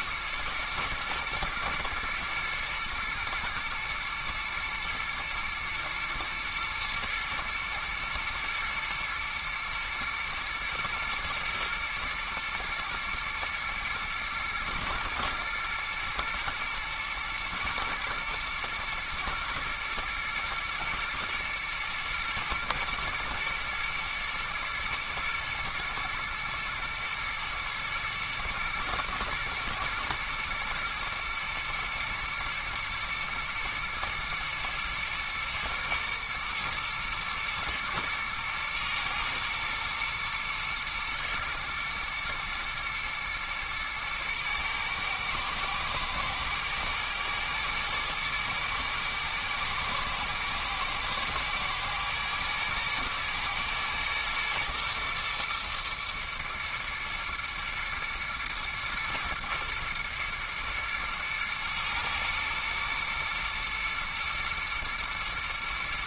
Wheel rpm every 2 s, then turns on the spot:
110, 110, 110, 110, 110, 120, 120, 120, 120, 110, 120, 120, 120, 110, 110, 110, 120, 120, 110, 120, 120, 120, 110, 110, 110, 120, 120, 120, 120, 120, 110, 120, 120.
none